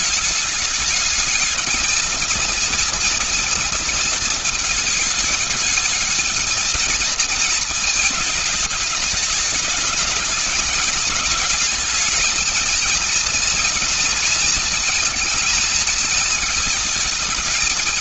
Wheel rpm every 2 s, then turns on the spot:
210, 230, 220, 220, 210, 210, 230, 230, 220.
none